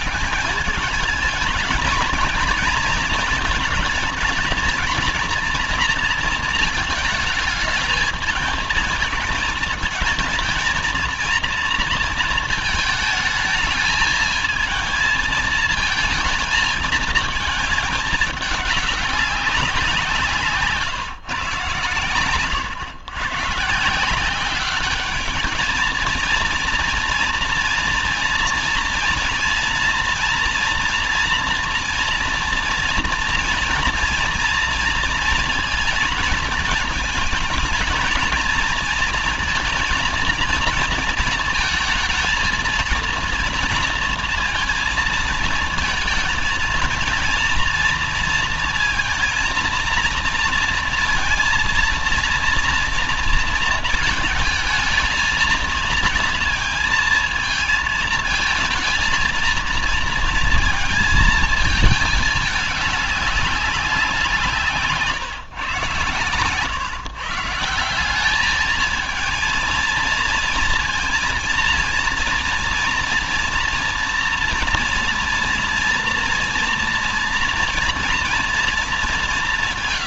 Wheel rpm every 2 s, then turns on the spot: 210, 220, 230, 220, 220, 220, 220, 220, 220, 210, 170, 100, 200, 230, 230, 230, 230, 230, 220, 220, 230, 220, 230, 230, 230, 230, 230, 220, 230, 220, 230, 210, 160, 130, 210, 230, 230, 230, 230, 230.
none